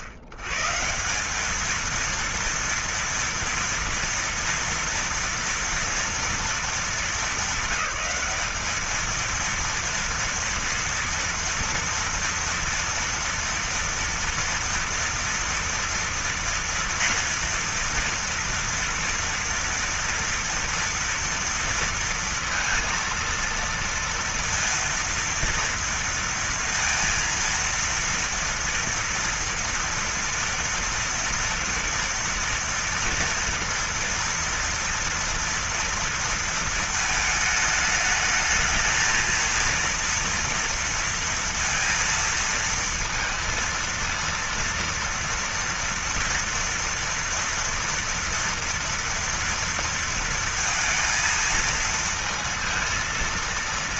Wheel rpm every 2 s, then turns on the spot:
110, 230, 230, 230, 210, 230, 230, 230, 230, 230, 230, 230, 230, 230, 230, 240, 240, 230, 230, 220, 230, 230, 230, 230, 230, 230, 230.
none